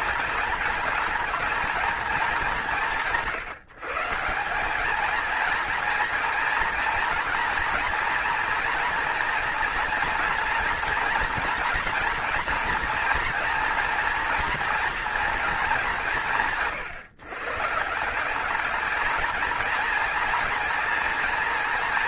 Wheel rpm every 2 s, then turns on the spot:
210, 170, 220, 240, 240, 230, 230, 230, 140, 210, 240.
none